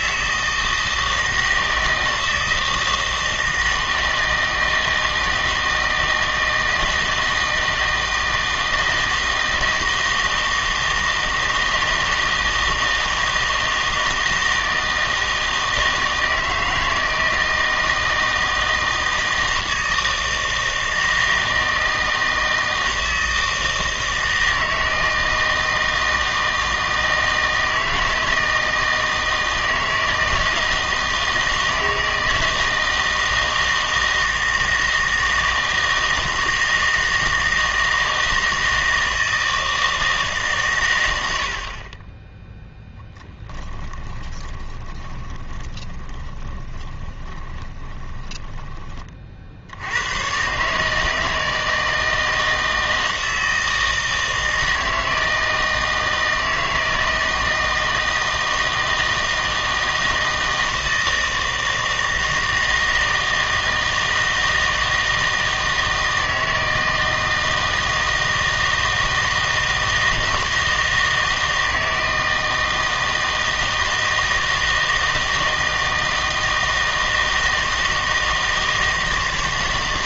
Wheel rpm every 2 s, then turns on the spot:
160, 160, 160, 160, 160, 160, 160, 160, 160, 160, 160, 160, 160, 160, 160, 160, 160, 160, 160, 160, 140, 0, 20, 20, 20, 140, 160, 160, 160, 160, 160, 160, 160, 160, 160, 160, 160, 160, 160, 160.
44-48